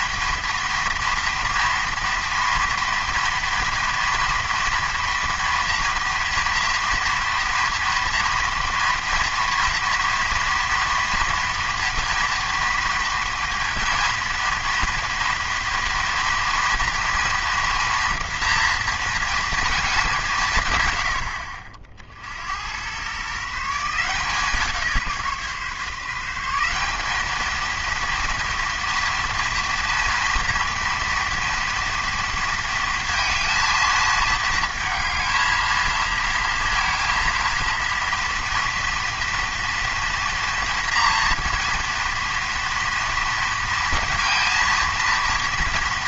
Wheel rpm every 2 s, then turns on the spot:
230, 230, 230, 230, 240, 230, 230, 230, 230, 230, 120, 100, 170, 190, 230, 230, 230, 220, 230, 230, 240, 230, 230.
none